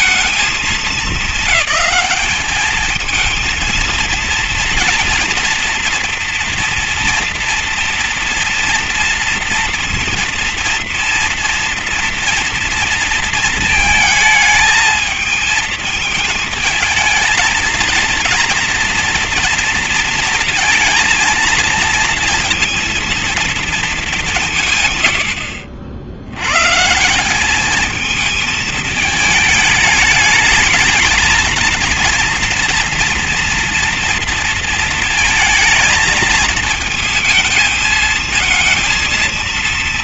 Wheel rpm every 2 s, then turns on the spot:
220, 220, 230, 230, 230, 230, 230, 220, 220, 230, 230, 230, 160, 120, 220, 210, 230, 230, 220, 220.
none